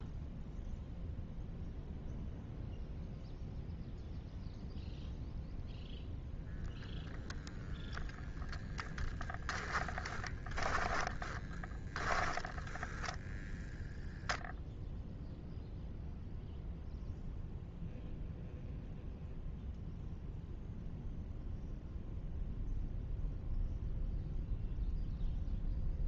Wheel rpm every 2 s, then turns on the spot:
0, 0, 0, 0, 10, 10, 10, 0, 0, 0, 0, 0, 0.
10-14